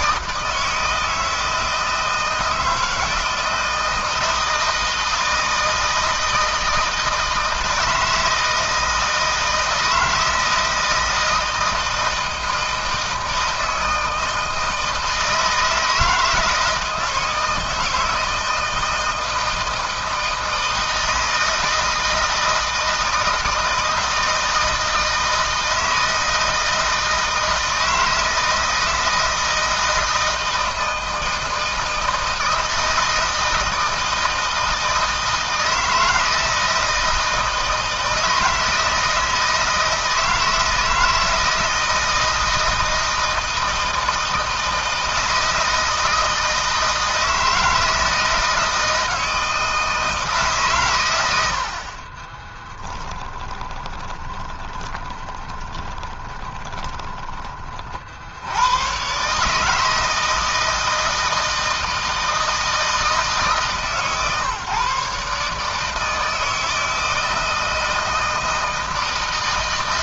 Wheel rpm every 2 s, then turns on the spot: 160, 160, 160, 160, 160, 160, 160, 160, 160, 160, 160, 160, 160, 160, 160, 160, 160, 160, 160, 160, 160, 160, 160, 160, 160, 130, 20, 30, 20, 110, 160, 160, 150, 160, 160.
52-58